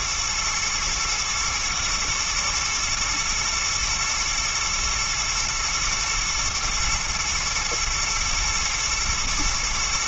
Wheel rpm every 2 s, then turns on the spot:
120, 110, 110, 120, 110.
none